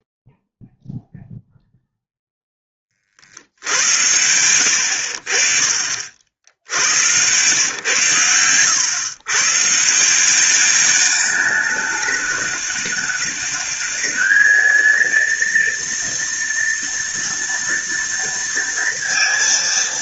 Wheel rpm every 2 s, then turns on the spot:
0, 30, 80, 80, 110, 200, 210, 230, 230, 230.
4-6